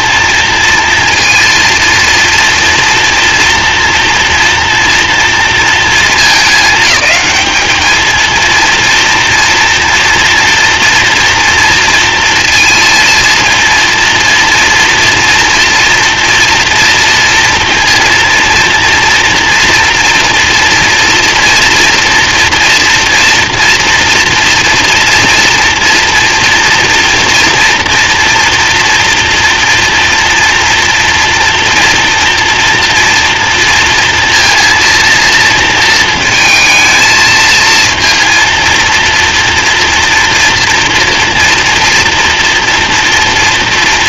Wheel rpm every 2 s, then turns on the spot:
230, 230, 230, 220, 230, 230, 230, 230, 230, 230, 230, 230, 230, 230, 230, 240, 230, 230, 220, 230, 230, 230.
none